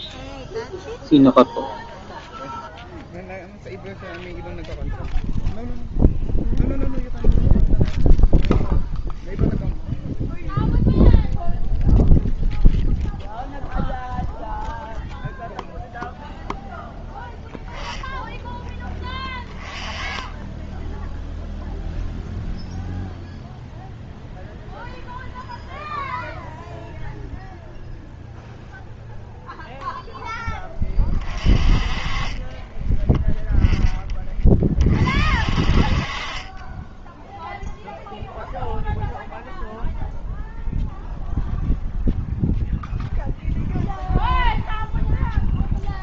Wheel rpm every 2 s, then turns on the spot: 0, 0, 0, 0, 0, 0, 0, 0, 0, 10, 10, 0, 0, 0, 0, 10, 20, 30, 30, 0, 0, 0, 0.
32-34 36-38